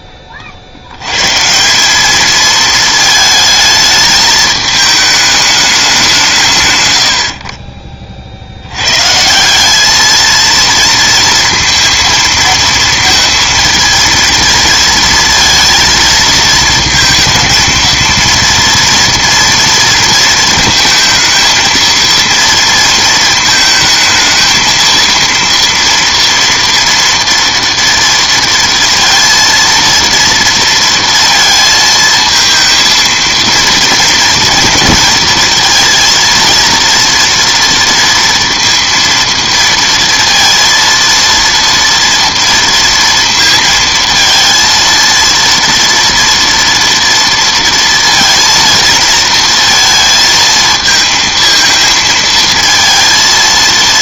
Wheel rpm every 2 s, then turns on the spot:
70, 220, 220, 140, 90, 230, 230, 230, 220, 230, 230, 230, 230, 230, 230, 230, 220, 230, 230, 230, 230, 230, 230, 230, 230, 220, 230.
none